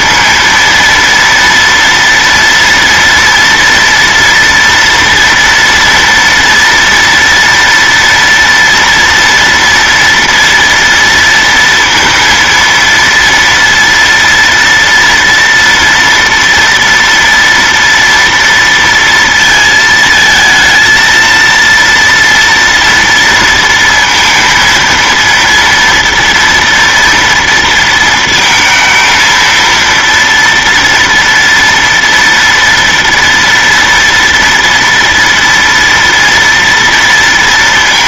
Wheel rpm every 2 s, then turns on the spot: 230, 230, 230, 230, 230, 230, 230, 230, 230, 230, 220, 230, 230, 230, 220, 230, 240, 230, 230.
none